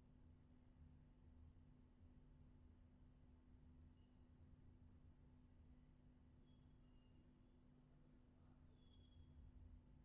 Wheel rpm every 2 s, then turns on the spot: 0, 0, 0, 0, 0.
none